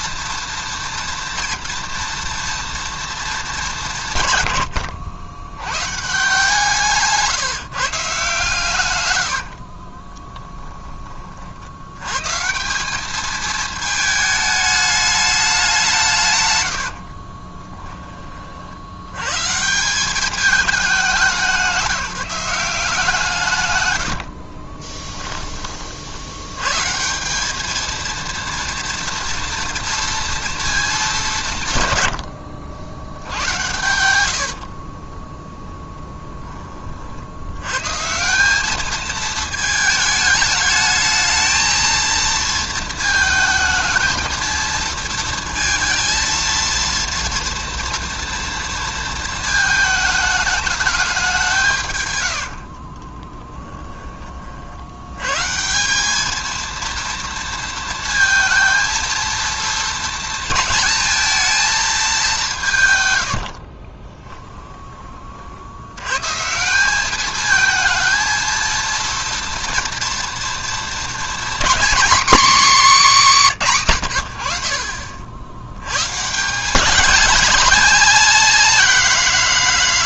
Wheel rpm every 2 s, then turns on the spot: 230, 230, 110, 160, 120, 20, 180, 210, 90, 80, 210, 180, 30, 120, 230, 220, 70, 50, 30, 210, 210, 230, 230, 230, 230, 210, 60, 40, 220, 230, 230, 150, 20, 170, 230, 230, 250, 60, 190, 230.
16-18 24-26 34-36 52-54